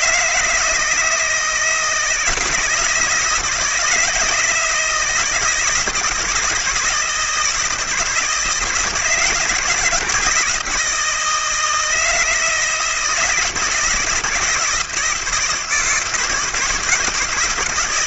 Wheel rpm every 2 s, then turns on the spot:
160, 170, 160, 160, 160, 170, 170, 160, 160.
none